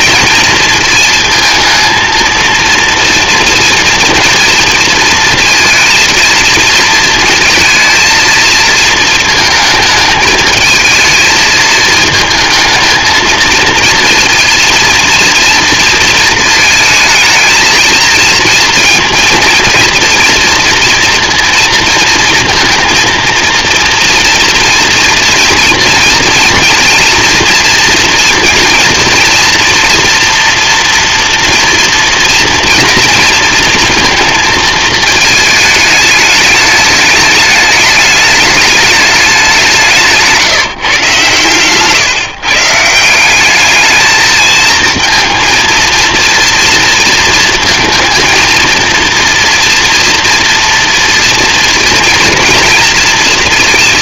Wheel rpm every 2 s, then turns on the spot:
230, 230, 230, 230, 230, 220, 220, 230, 220, 230, 230, 230, 230, 230, 230, 230, 230, 220, 210, 210, 170, 150, 220, 230, 230, 230, 230.
none